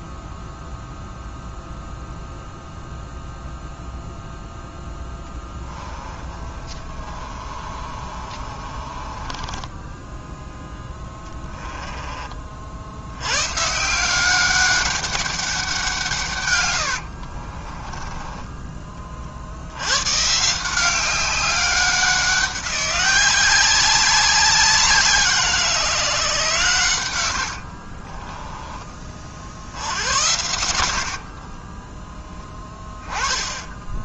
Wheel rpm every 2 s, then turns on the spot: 0, 0, 0, 30, 30, 10, 70, 200, 90, 20, 170, 190, 180, 120, 20, 80, 10.
6-10 16-18 30-32